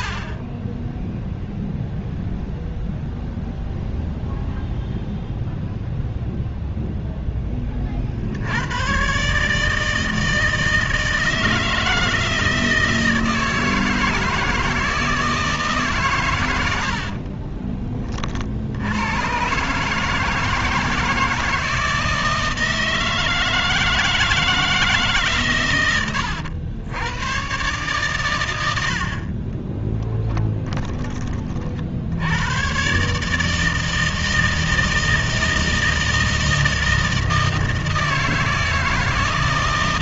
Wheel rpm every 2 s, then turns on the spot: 20, 0, 0, 0, 90, 160, 160, 160, 100, 60, 160, 160, 160, 90, 90, 20, 100, 160, 160, 160.
30-32